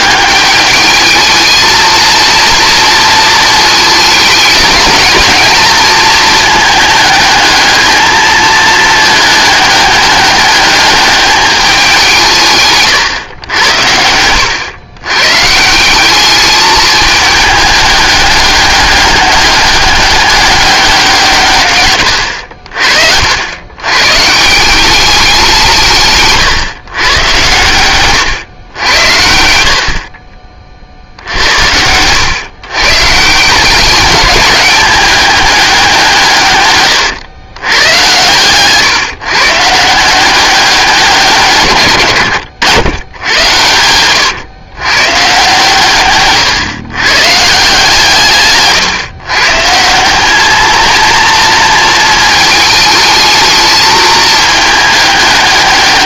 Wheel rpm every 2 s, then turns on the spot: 210, 230, 220, 210, 220, 210, 130, 110, 210, 200, 190, 60, 180, 130, 100, 50, 130, 200, 120, 130, 190, 100, 120, 130, 130, 220, 220, 220.
none